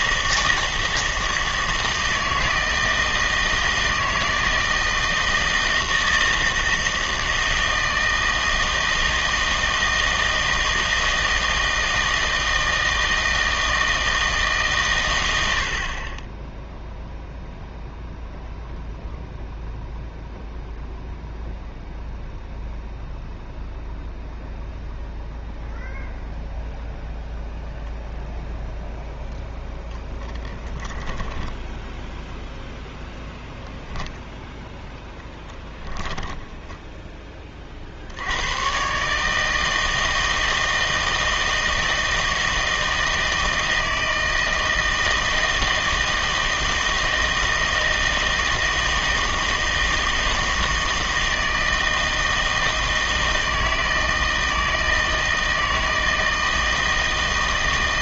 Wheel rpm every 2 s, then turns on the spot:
160, 160, 160, 160, 160, 160, 160, 130, 0, 0, 0, 0, 0, 0, 0, 10, 0, 10, 10, 130, 160, 160, 160, 160, 160, 160, 160, 160, 160.
36-38